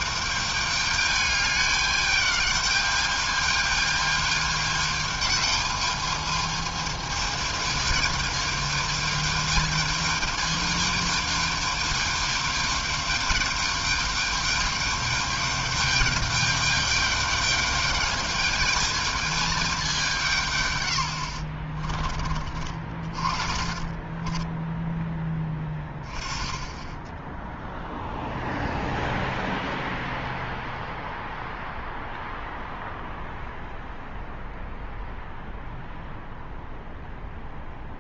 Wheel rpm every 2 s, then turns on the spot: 210, 210, 210, 210, 220, 220, 210, 210, 210, 220, 90, 40, 10, 0, 0, 0, 0, 0, 0.
20-24